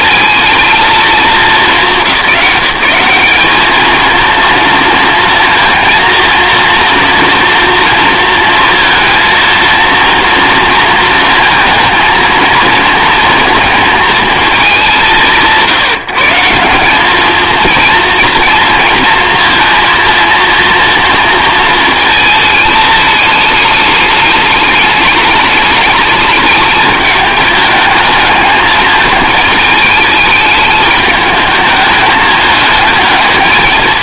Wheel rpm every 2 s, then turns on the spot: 230, 190, 230, 230, 230, 230, 230, 190, 180, 230, 230, 220, 210, 210, 210, 210, 210.
none